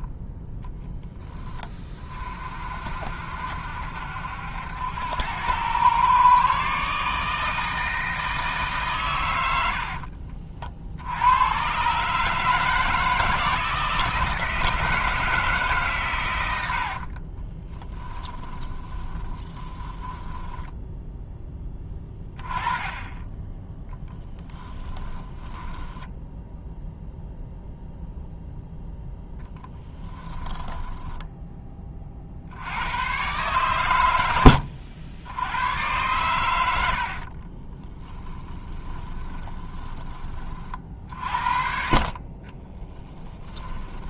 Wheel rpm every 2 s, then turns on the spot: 20, 50, 80, 140, 150, 60, 160, 160, 70, 20, 10, 20, 10, 0, 0, 10, 90, 80, 80, 10, 40, 10.
16-22 24-26 30-32 38-40 42-44